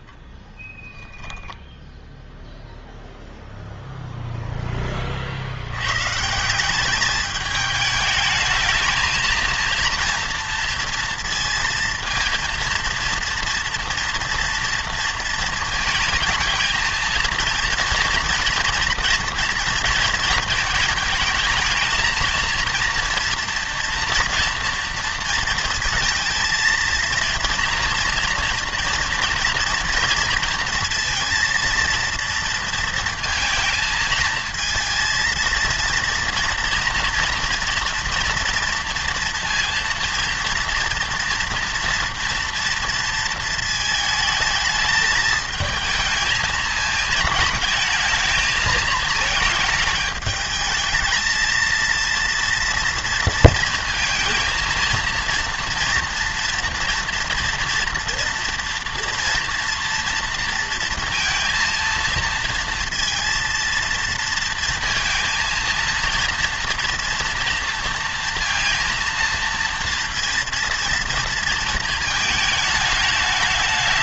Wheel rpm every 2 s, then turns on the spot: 0, 0, 10, 180, 220, 230, 230, 230, 220, 230, 220, 230, 230, 230, 230, 230, 230, 230, 240, 230, 230, 230, 220, 220, 220, 220, 230, 230, 230, 230, 230, 230, 230, 230, 230, 230, 220.
none